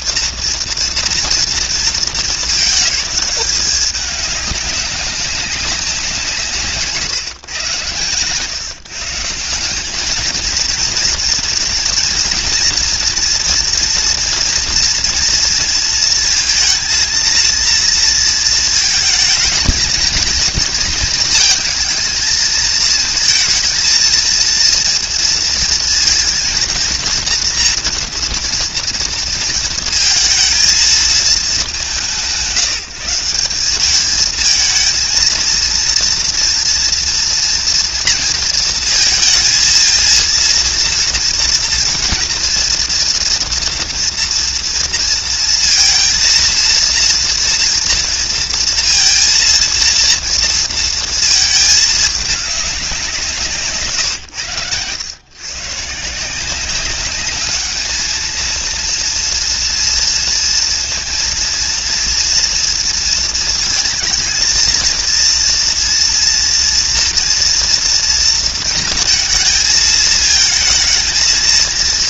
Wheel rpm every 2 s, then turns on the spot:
240, 220, 210, 150, 130, 230, 230, 240, 230, 230, 230, 220, 230, 230, 230, 220, 180, 220, 230, 230, 230, 240, 230, 230, 230, 230, 210, 110, 180, 230, 230, 240, 230, 230, 230, 220.
none